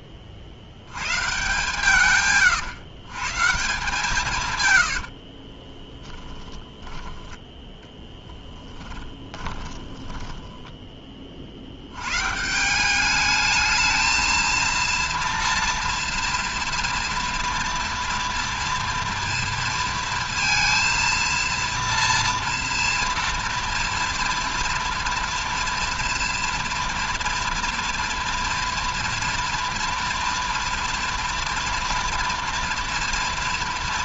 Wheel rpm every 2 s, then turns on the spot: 130, 140, 60, 10, 20, 10, 190, 230, 230, 230, 230, 230, 230, 230, 230, 230, 230.
4-6 8-10